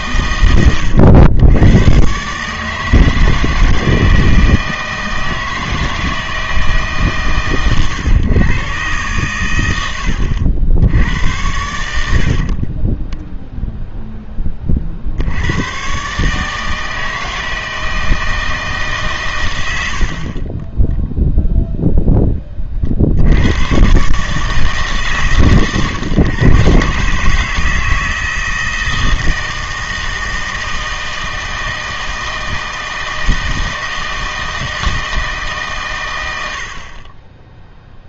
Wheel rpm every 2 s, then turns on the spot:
100, 150, 160, 160, 130, 80, 30, 20, 150, 150, 10, 30, 150, 130, 160, 160, 160, 160, 70.
12-14